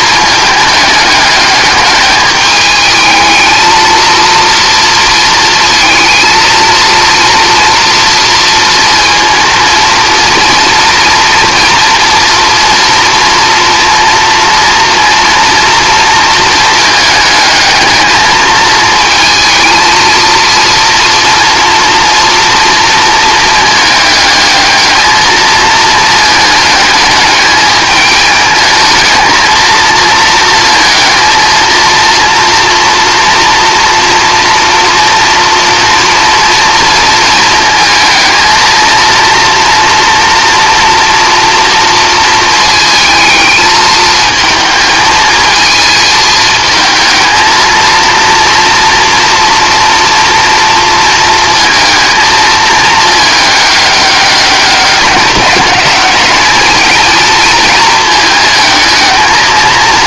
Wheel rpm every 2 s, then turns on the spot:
210, 210, 230, 230, 230, 240, 230, 230, 220, 220, 230, 230, 210, 220, 220, 230, 230, 230, 230, 230, 230, 220, 220, 220, 230, 230, 220, 200, 220, 220.
none